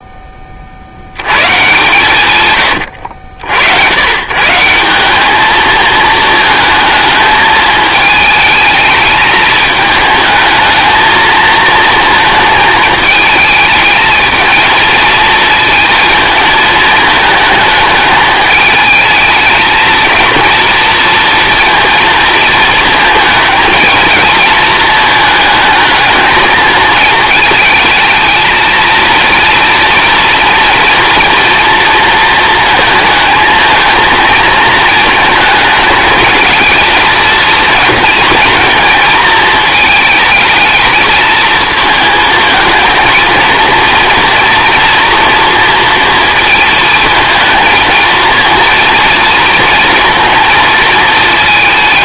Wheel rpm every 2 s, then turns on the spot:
80, 90, 190, 220, 220, 220, 220, 220, 220, 220, 230, 230, 220, 230, 220, 230, 230, 220, 230, 230, 220, 220, 230, 230, 230, 220.
2-4